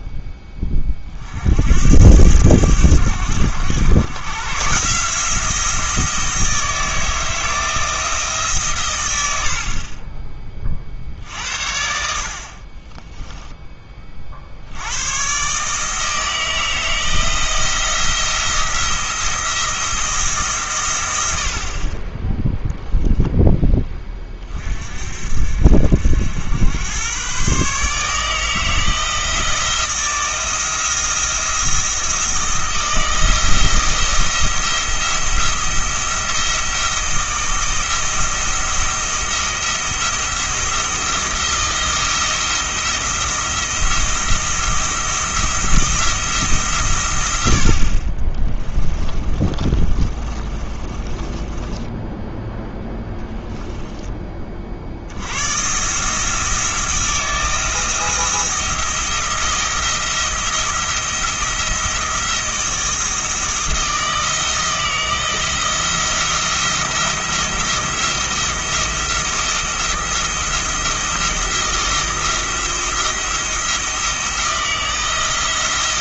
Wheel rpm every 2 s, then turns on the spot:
30, 100, 140, 160, 130, 40, 20, 90, 160, 170, 130, 0, 40, 100, 160, 170, 170, 170, 160, 170, 170, 170, 170, 140, 20, 30, 10, 50, 170, 170, 170, 160, 160, 170, 170, 170, 170, 170.
12-14 48-52